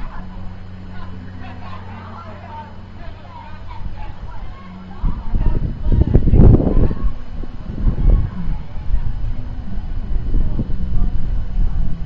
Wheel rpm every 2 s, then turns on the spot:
0, 0, 0, 0, 0, 0.
none